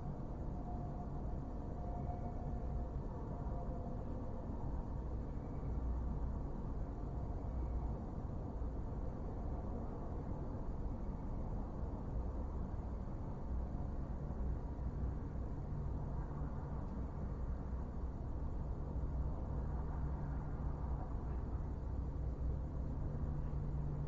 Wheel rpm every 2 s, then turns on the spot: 0, 0, 0, 0, 0, 0, 0, 0, 0, 0, 0, 0.
none